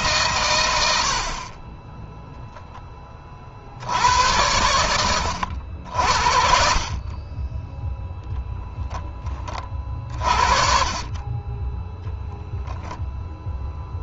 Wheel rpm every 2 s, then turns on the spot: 90, 20, 100, 40, 10, 30, 0.
none